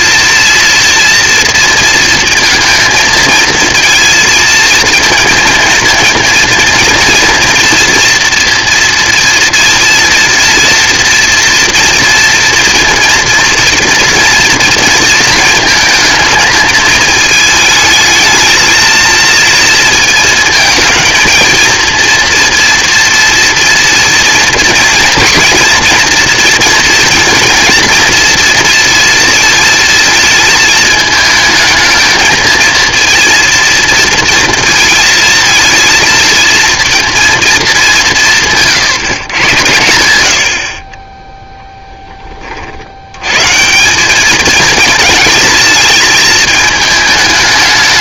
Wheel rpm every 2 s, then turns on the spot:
230, 230, 230, 230, 230, 230, 230, 230, 220, 220, 230, 230, 230, 230, 230, 220, 230, 230, 230, 160, 50, 60, 220, 220.
38-40